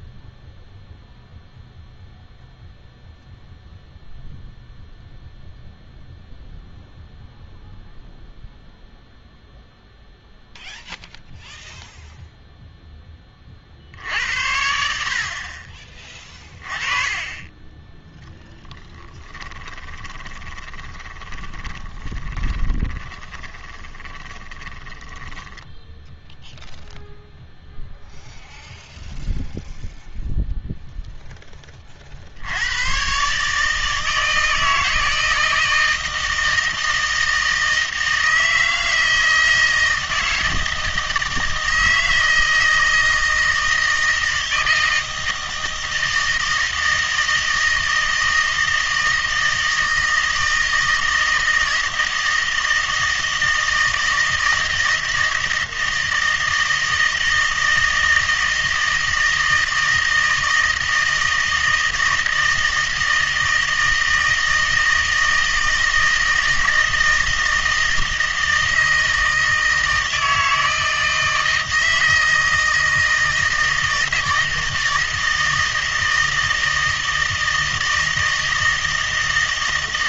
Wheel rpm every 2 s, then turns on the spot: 0, 0, 0, 0, 0, 0, 0, 70, 20, 10, 20, 20, 10, 0, 0, 0, 100, 160, 160, 160, 160, 160, 160, 160, 160, 160, 160, 160, 160, 160, 160, 160, 160, 160, 160, 160, 160, 160, 160, 160.
18-26